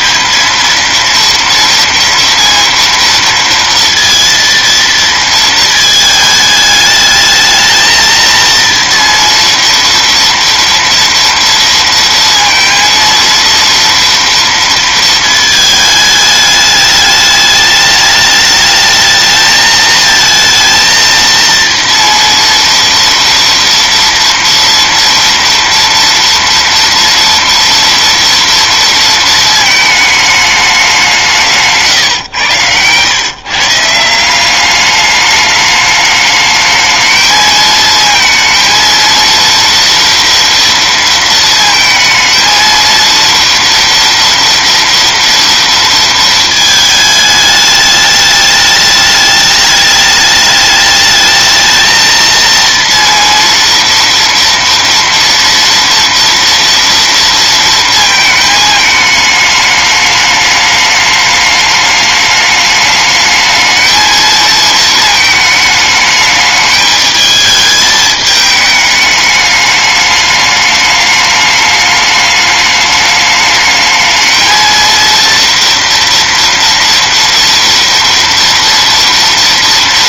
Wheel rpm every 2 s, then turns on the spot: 220, 230, 230, 210, 230, 230, 230, 230, 210, 220, 230, 230, 230, 230, 230, 200, 110, 200, 220, 230, 230, 220, 230, 220, 210, 210, 230, 230, 230, 220, 210, 210, 220, 210, 210, 210, 210, 220, 230, 230.
none